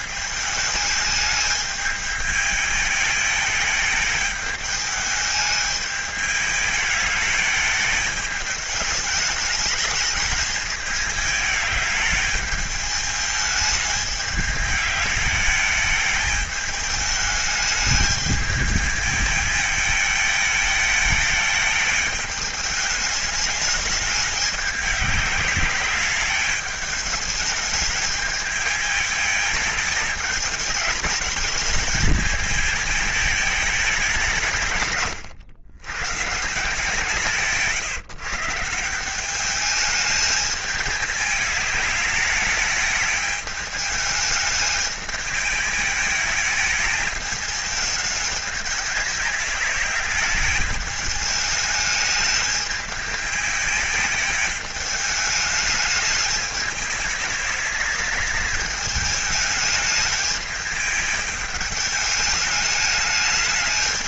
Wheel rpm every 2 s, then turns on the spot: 220, 210, 210, 210, 210, 220, 210, 210, 220, 220, 220, 210, 200, 210, 220, 210, 220, 130, 160, 170, 220, 210, 210, 220, 210, 210, 220, 210, 210, 210, 210, 210.
none